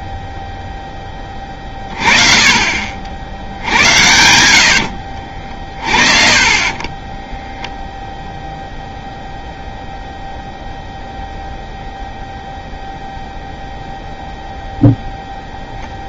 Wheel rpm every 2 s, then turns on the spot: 10, 50, 70, 30, 0, 0, 0, 0.
6-8